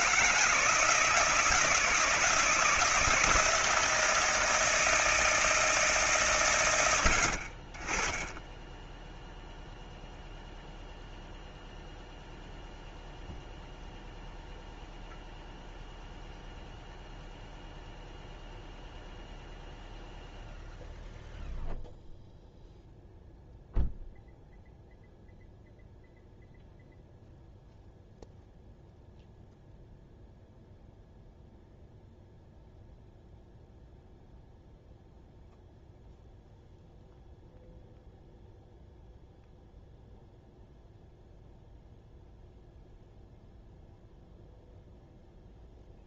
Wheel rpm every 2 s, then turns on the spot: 160, 170, 160, 120, 10, 0, 0, 0, 0, 0, 0, 0, 0, 0, 0, 0, 0, 0, 0, 0, 0, 0, 0.
none